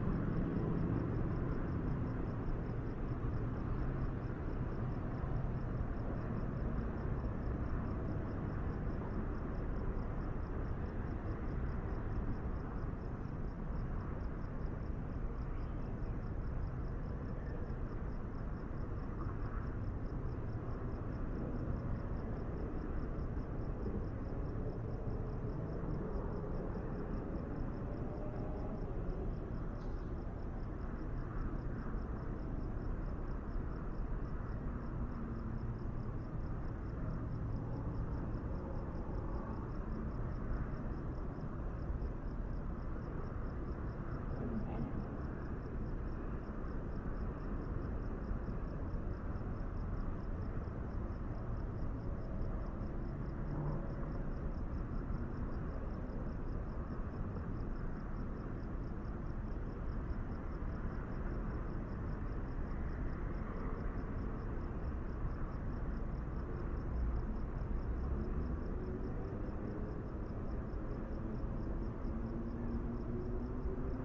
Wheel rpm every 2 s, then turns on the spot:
0, 0, 0, 0, 0, 0, 0, 0, 0, 0, 0, 0, 0, 0, 0, 0, 0, 0, 0, 0, 0, 0, 0, 0, 0, 0, 0, 0, 0, 0, 0, 0, 0, 0, 0, 0, 0.
none